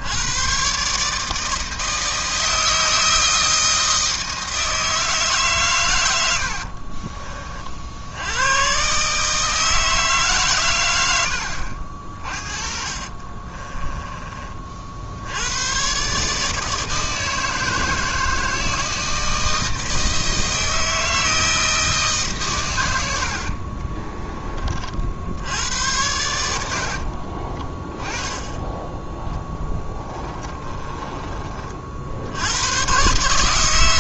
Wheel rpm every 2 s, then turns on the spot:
130, 160, 160, 50, 120, 130, 40, 50, 150, 160, 160, 110, 40, 70, 10, 20, 100.
6-8 12-14 26-28 30-32